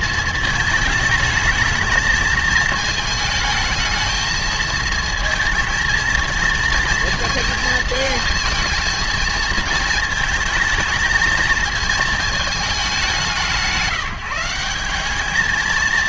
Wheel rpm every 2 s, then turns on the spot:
220, 220, 220, 230, 220, 220, 200, 180.
none